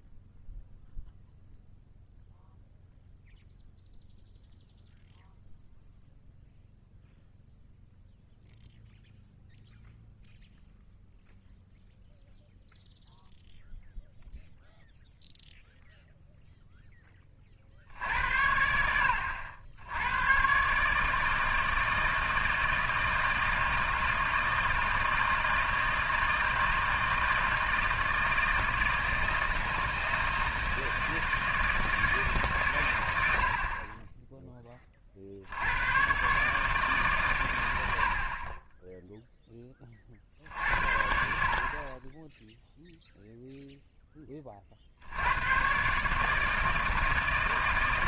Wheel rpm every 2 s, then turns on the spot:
0, 0, 0, 0, 0, 0, 0, 0, 20, 70, 150, 160, 160, 160, 160, 160, 100, 40, 140, 0, 60, 0, 70, 160.
none